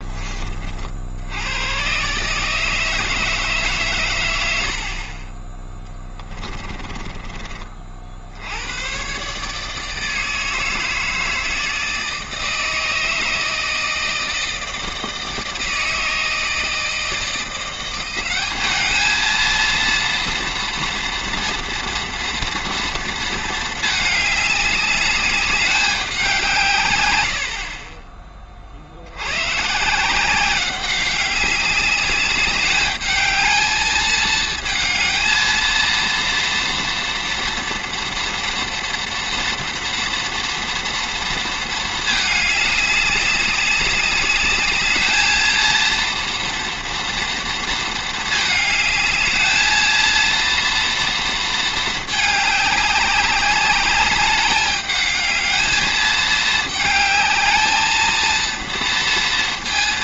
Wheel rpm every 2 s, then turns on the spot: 40, 150, 70, 20, 90, 160, 160, 160, 160, 210, 230, 230, 210, 140, 60, 190, 210, 220, 240, 230, 230, 210, 210, 240, 220, 230, 200, 210, 210, 230.
4-8